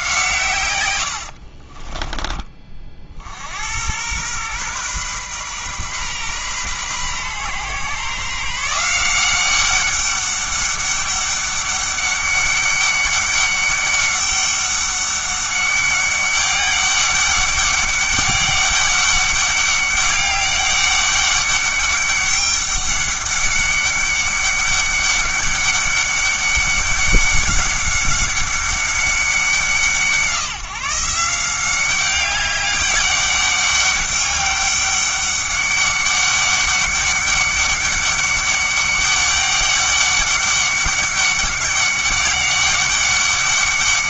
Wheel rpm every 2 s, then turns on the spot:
110, 40, 120, 130, 160, 200, 200, 200, 200, 200, 200, 200, 200, 200, 200, 150, 200, 200, 200, 200, 200, 200.
none